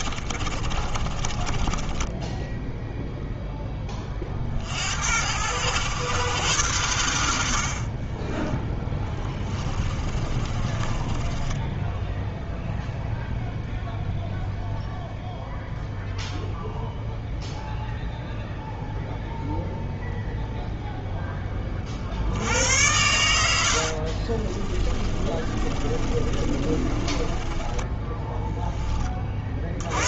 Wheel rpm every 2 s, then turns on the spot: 30, 0, 60, 100, 10, 20, 0, 0, 0, 0, 0, 80, 30, 30, 10.
0-2 8-12 24-28